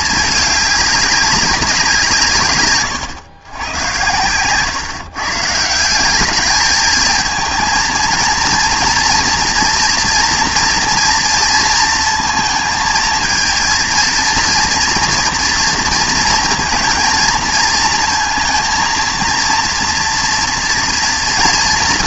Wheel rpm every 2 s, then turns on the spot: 210, 150, 120, 210, 230, 230, 230, 230, 230, 230, 230.
4-6